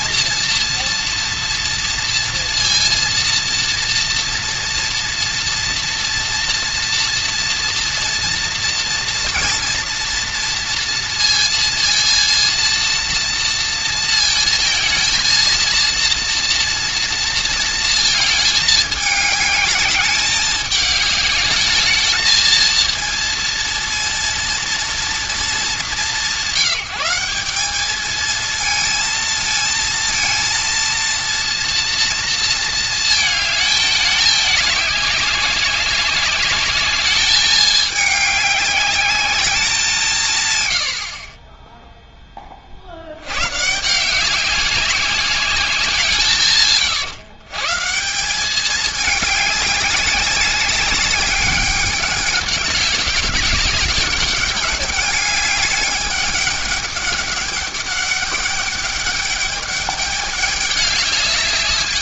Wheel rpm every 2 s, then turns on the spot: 230, 230, 240, 230, 230, 230, 230, 230, 230, 210, 210, 230, 230, 180, 230, 230, 230, 200, 200, 200, 100, 30, 190, 140, 210, 200, 200, 210, 200, 200, 200.
none